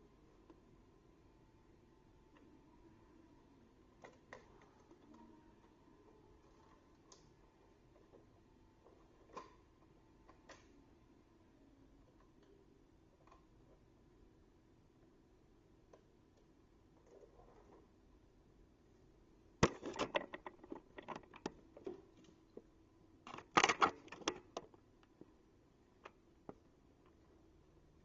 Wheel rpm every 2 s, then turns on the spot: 0, 0, 0, 0, 0, 0, 0, 0, 0, 0, 0, 0, 0, 0.
none